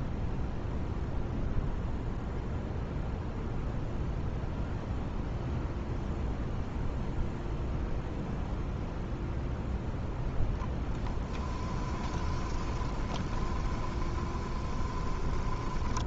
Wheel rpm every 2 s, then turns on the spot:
0, 0, 0, 0, 0, 10, 20, 20.
10-16